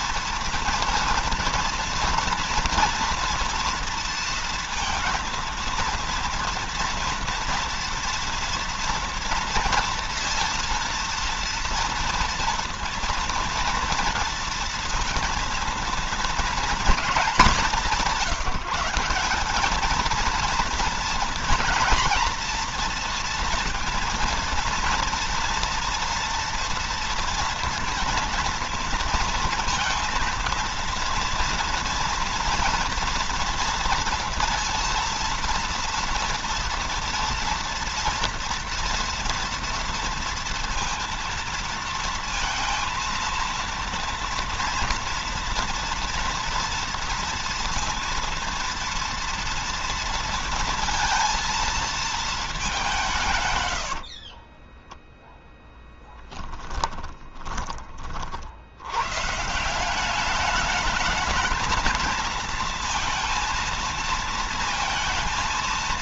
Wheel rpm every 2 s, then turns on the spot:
230, 230, 230, 230, 230, 230, 230, 230, 230, 170, 230, 230, 230, 230, 230, 230, 230, 230, 230, 240, 230, 230, 230, 230, 230, 230, 200, 20, 10, 80, 210, 230, 230.
54-58